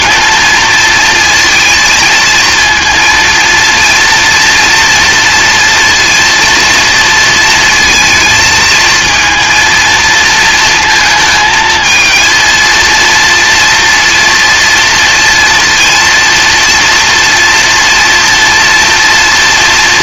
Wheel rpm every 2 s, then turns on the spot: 230, 230, 240, 230, 220, 230, 230, 230, 230, 240.
none